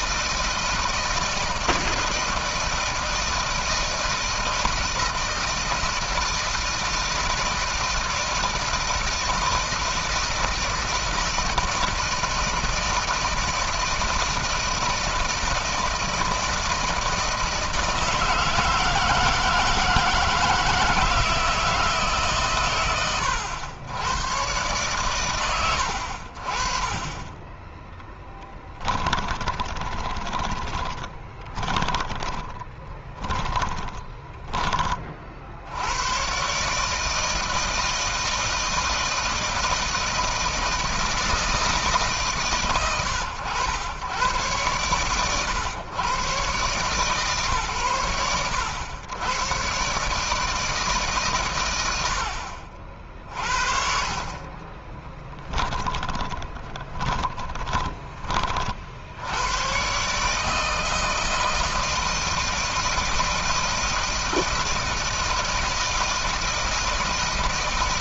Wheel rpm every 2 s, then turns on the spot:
160, 160, 160, 160, 160, 160, 160, 160, 160, 160, 160, 130, 120, 40, 10, 20, 20, 20, 140, 160, 160, 130, 110, 130, 90, 150, 60, 30, 20, 40, 160, 160, 160, 160.
28-34 54-58